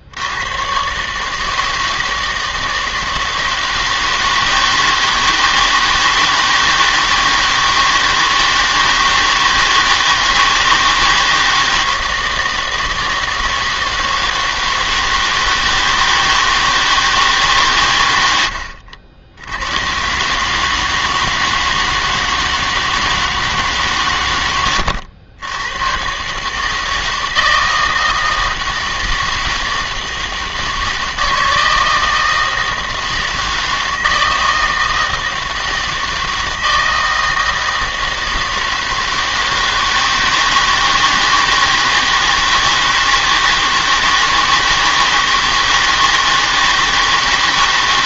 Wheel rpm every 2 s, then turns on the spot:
110, 160, 160, 160, 160, 160, 160, 160, 160, 90, 150, 160, 90, 150, 160, 160, 160, 160, 160, 160, 160, 160, 160, 160.
24-26